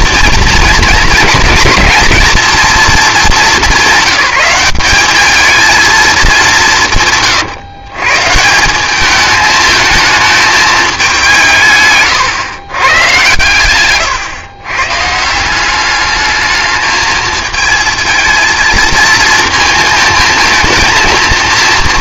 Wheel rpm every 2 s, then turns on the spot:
230, 230, 190, 170, 190, 210, 120, 130, 210, 220, 230.
none